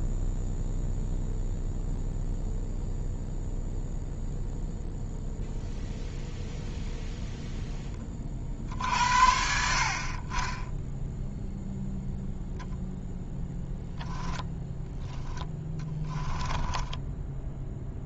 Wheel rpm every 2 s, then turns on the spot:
0, 0, 0, 0, 60, 10, 0, 10, 10.
14-18